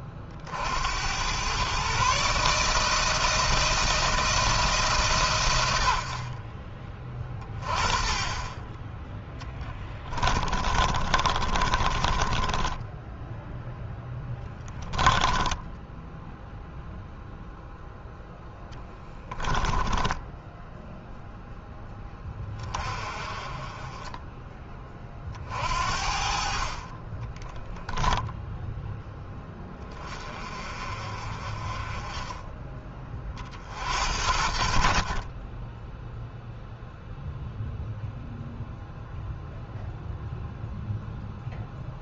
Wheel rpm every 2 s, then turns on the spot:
90, 160, 160, 40, 20, 30, 10, 10, 0, 10, 10, 20, 20, 50, 0, 30, 20, 50, 0, 0, 0.
10-16 18-22